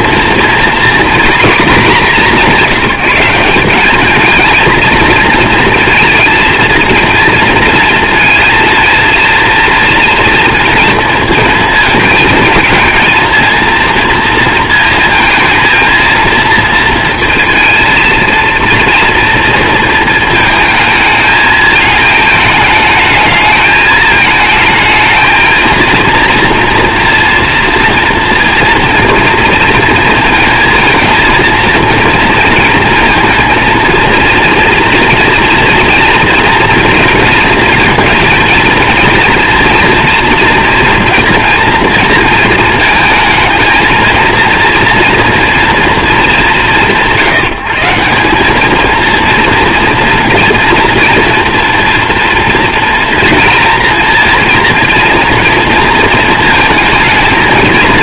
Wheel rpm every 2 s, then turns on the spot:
230, 180, 220, 230, 230, 230, 230, 230, 230, 230, 230, 220, 220, 240, 230, 230, 230, 230, 230, 220, 240, 220, 230, 170, 210, 230, 240, 230, 230.
none